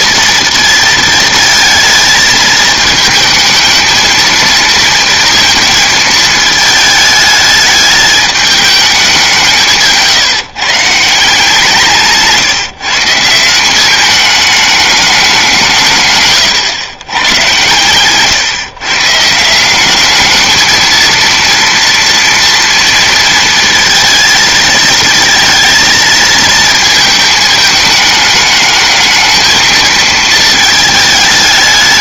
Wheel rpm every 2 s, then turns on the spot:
230, 220, 230, 220, 210, 140, 160, 210, 130, 140, 220, 230, 220, 220, 220, 220.
none